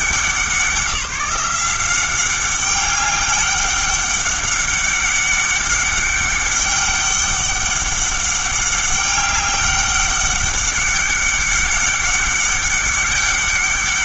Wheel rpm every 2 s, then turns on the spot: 170, 190, 200, 200, 200, 200, 200.
none